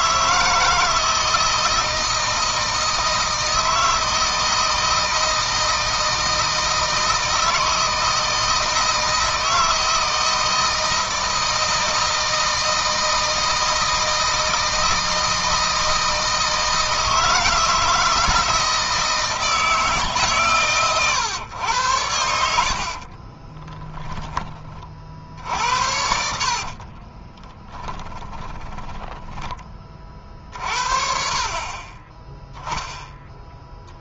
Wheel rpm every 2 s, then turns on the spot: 160, 160, 160, 160, 160, 160, 160, 160, 160, 160, 130, 70, 30, 50, 10, 40, 10.
22-24 26-30